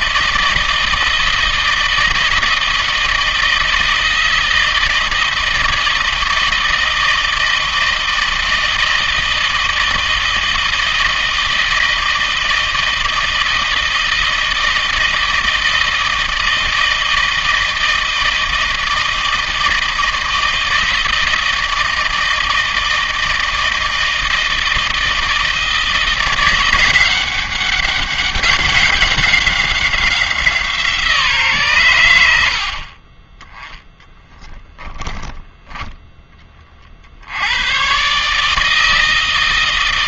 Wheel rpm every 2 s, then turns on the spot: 160, 160, 160, 160, 160, 160, 160, 160, 160, 160, 160, 160, 160, 180, 190, 170, 60, 10, 30, 160.
32-34